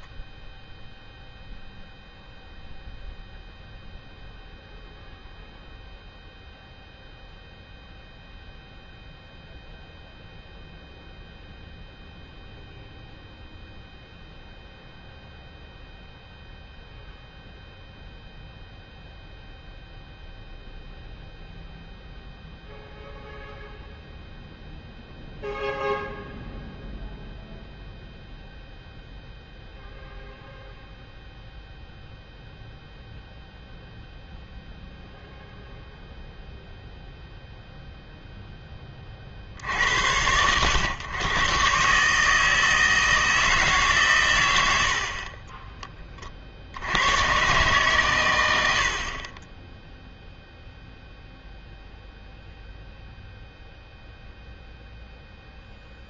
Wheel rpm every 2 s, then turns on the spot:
0, 0, 0, 0, 0, 0, 0, 0, 0, 0, 0, 0, 0, 0, 0, 0, 0, 0, 0, 10, 100, 160, 90, 60, 80, 0, 0, 0.
none